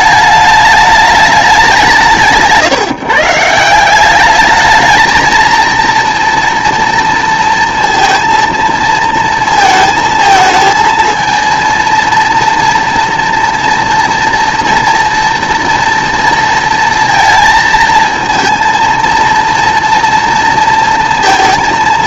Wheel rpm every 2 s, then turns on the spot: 210, 150, 220, 230, 230, 220, 230, 230, 230, 230, 230.
none